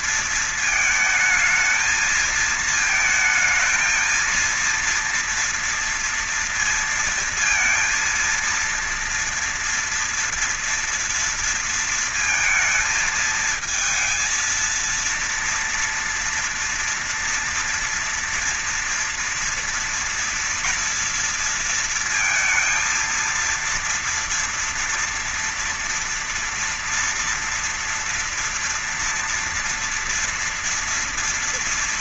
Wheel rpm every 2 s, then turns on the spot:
230, 220, 230, 230, 230, 230, 220, 230, 230, 230, 230, 230, 230, 240, 230, 230.
none